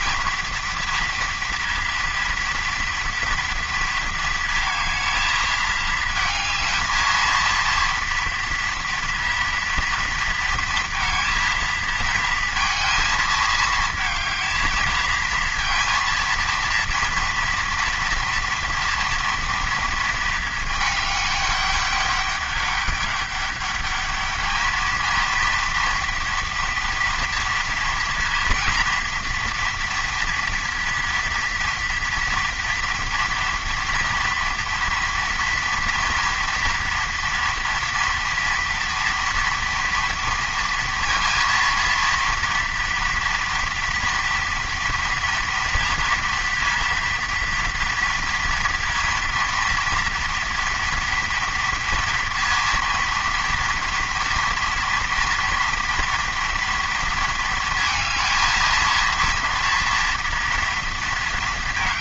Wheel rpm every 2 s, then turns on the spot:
230, 230, 230, 220, 230, 230, 230, 230, 230, 240, 210, 200, 220, 230, 230, 230, 230, 230, 230, 230, 230, 230, 230, 230, 230, 230, 230, 230, 230, 230, 230.
none